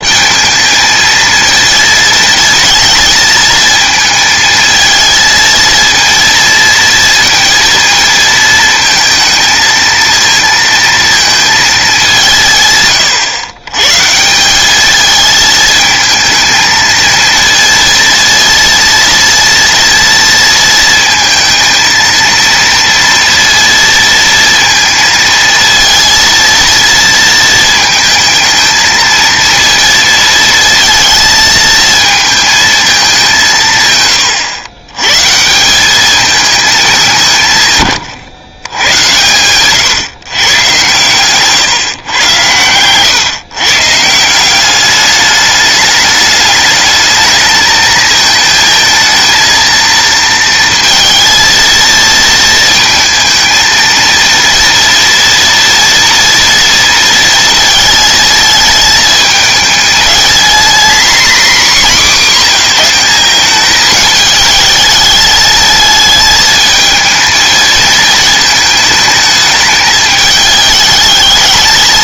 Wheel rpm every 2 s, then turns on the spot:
220, 220, 220, 230, 230, 230, 150, 190, 230, 230, 230, 230, 230, 230, 220, 230, 220, 100, 220, 120, 130, 110, 190, 210, 220, 230, 220, 230, 230, 220, 230, 200, 210, 220, 220, 210.
none